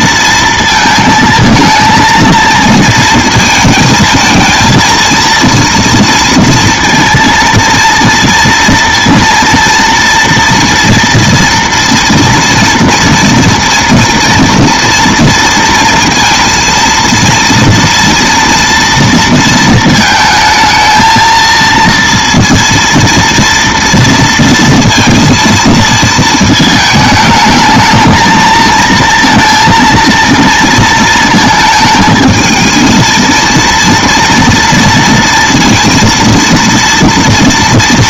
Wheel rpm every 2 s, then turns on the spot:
230, 230, 230, 230, 230, 230, 230, 230, 230, 230, 220, 230, 230, 220, 230, 230, 220, 230, 230.
none